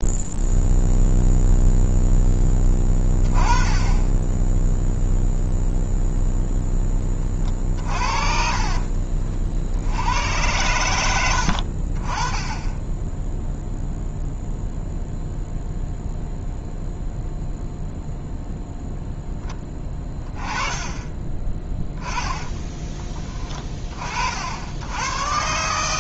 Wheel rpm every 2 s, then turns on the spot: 0, 10, 0, 0, 50, 100, 20, 0, 0, 0, 20, 20, 90.
8-10